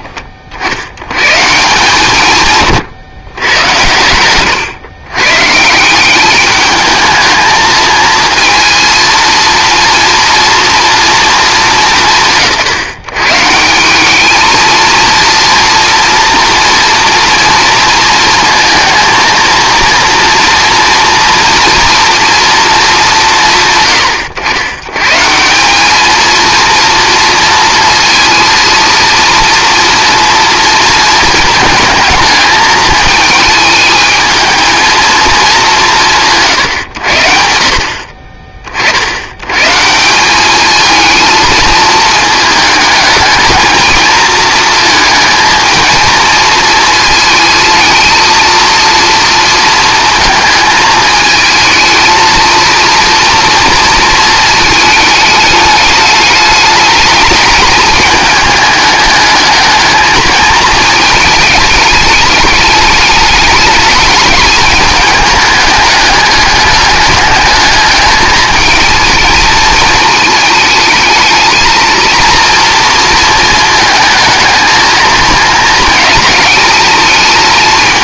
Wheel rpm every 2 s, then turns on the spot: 50, 140, 110, 210, 230, 230, 160, 230, 230, 230, 230, 230, 100, 230, 230, 230, 220, 220, 130, 40, 210, 220, 230, 230, 230, 230, 230, 220, 210, 210, 220, 210, 220, 210, 220, 220, 230, 220, 220.
none